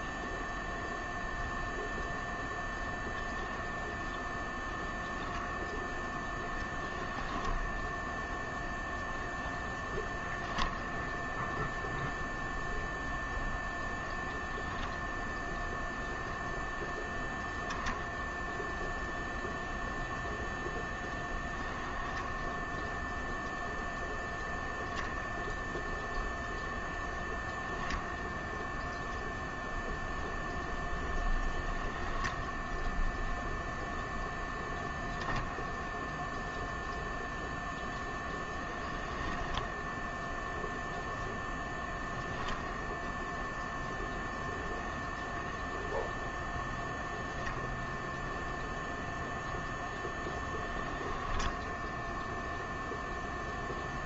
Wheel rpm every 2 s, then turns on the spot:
0, 0, 0, 10, 0, 0, 0, 0, 0, 0, 0, 0, 0, 0, 0, 0, 0, 0, 0, 10, 0, 0, 0, 0, 0, 10, 0.
38-40 50-52